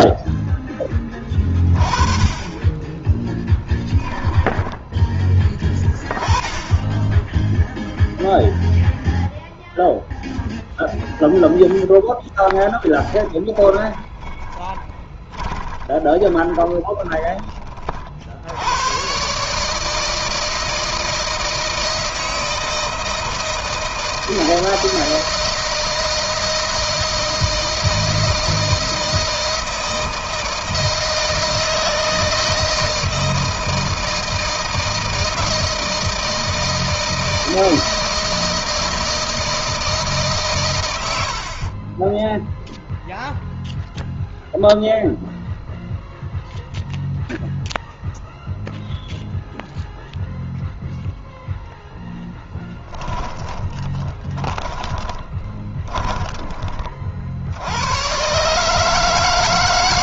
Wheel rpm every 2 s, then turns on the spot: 10, 10, 10, 10, 0, 0, 20, 20, 20, 100, 160, 160, 160, 160, 160, 160, 160, 160, 160, 160, 100, 0, 0, 0, 0, 0, 20, 20, 30, 150.
2-4 12-18 52-56